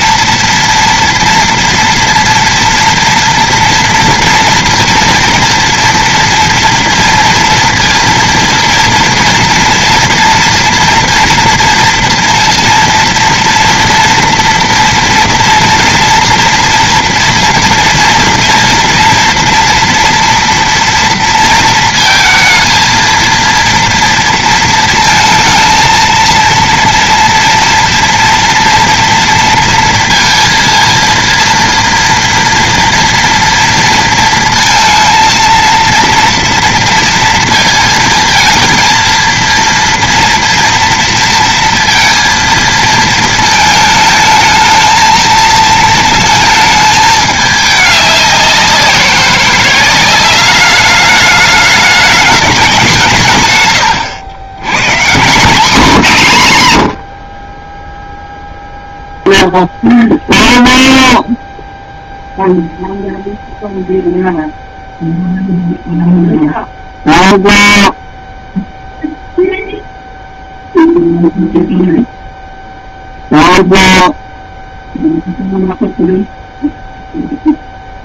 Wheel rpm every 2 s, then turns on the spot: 230, 230, 230, 230, 230, 230, 230, 240, 230, 230, 230, 230, 230, 230, 230, 230, 230, 230, 230, 230, 230, 220, 220, 210, 180, 200, 160, 180, 50, 0, 0, 0, 0, 0, 0, 0, 0, 0, 0.
56-58